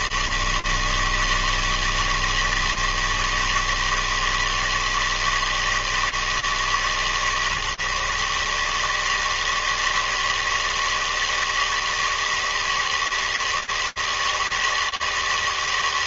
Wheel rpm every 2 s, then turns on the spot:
80, 160, 160, 160, 150, 160, 160, 160.
none